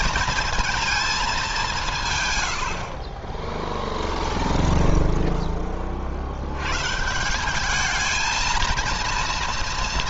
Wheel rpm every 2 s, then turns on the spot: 220, 50, 0, 140, 230.
none